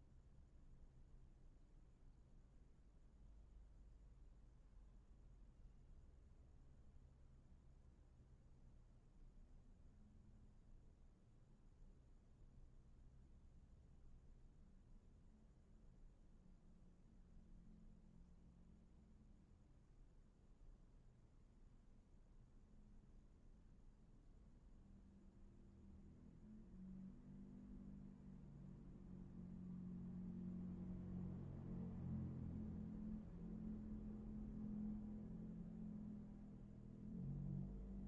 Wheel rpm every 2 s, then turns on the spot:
0, 0, 0, 0, 0, 0, 0, 0, 0, 0, 0, 0, 0, 0, 0, 0, 0, 0, 0.
none